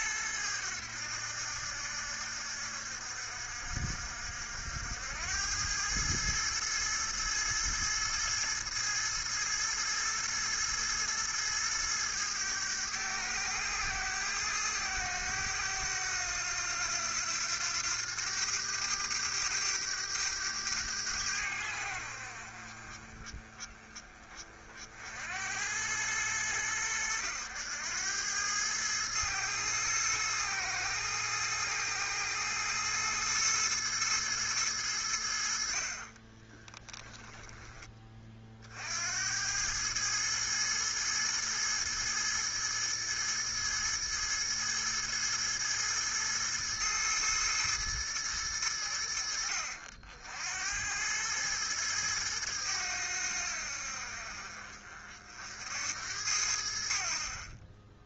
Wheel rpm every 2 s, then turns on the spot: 100, 70, 70, 110, 110, 110, 110, 110, 90, 100, 100, 50, 40, 100, 100, 110, 110, 110, 20, 40, 110, 110, 110, 110, 100, 80, 100, 50, 80.
36-38